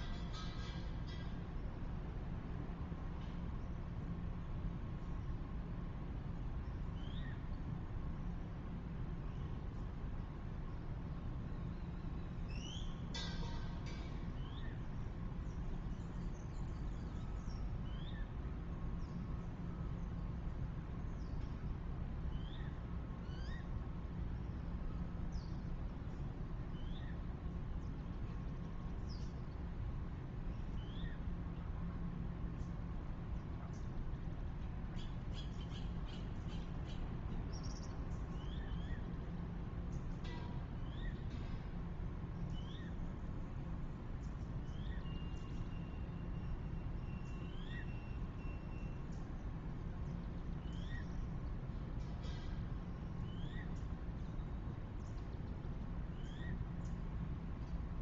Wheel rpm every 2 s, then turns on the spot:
0, 0, 0, 0, 0, 0, 0, 0, 0, 0, 0, 0, 0, 0, 0, 0, 0, 0, 0, 0, 0, 0, 0, 0, 0, 0, 0, 0, 0.
none